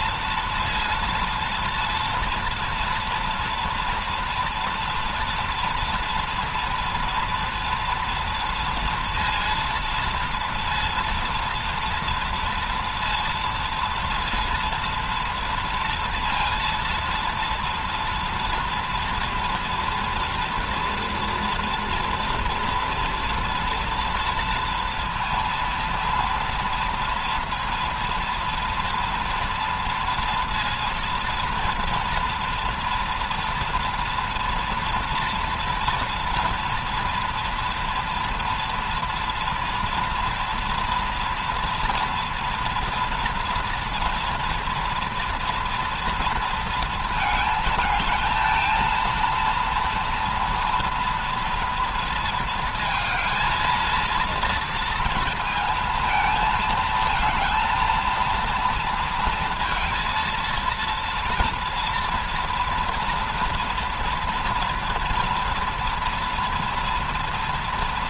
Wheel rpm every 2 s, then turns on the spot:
230, 230, 230, 230, 230, 230, 230, 230, 230, 230, 230, 240, 230, 240, 230, 230, 230, 240, 240, 230, 230, 240, 230, 230, 220, 230, 220, 230, 220, 230, 230, 230, 230, 230.
none